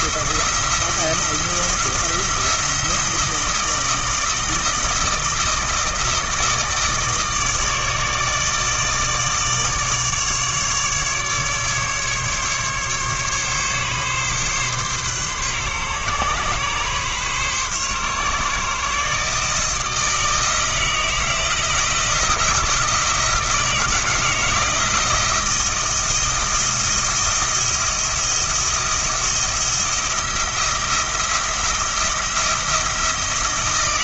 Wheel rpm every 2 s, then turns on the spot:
170, 170, 160, 160, 160, 150, 140, 130, 130, 140, 160, 170, 160, 170, 170, 170, 170.
none